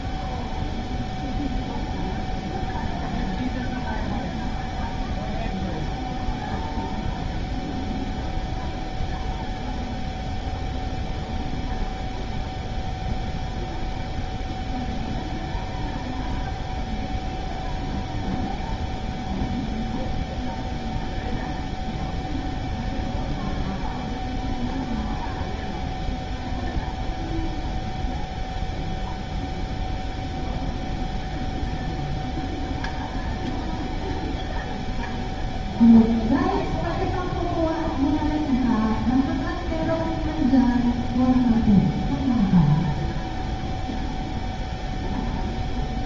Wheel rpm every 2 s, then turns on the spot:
0, 0, 0, 0, 0, 0, 0, 0, 0, 0, 0, 0, 0, 0, 0, 0, 0, 0, 0, 0, 0, 0, 0.
none